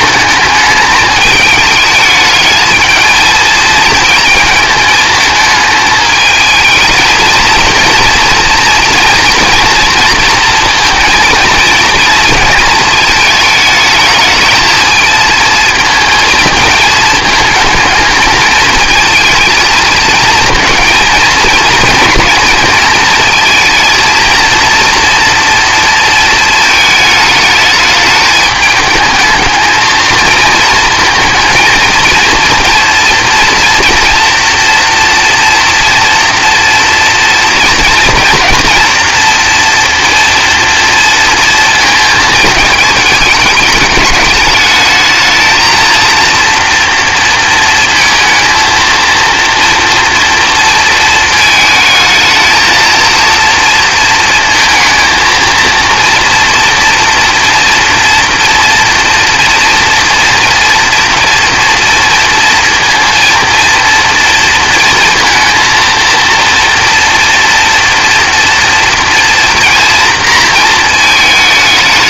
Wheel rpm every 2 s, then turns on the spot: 210, 220, 220, 220, 230, 230, 230, 220, 220, 220, 230, 230, 230, 220, 210, 220, 230, 230, 230, 230, 230, 220, 210, 240, 230, 230, 230, 230, 230, 230, 230, 230, 230, 230, 230, 230.
none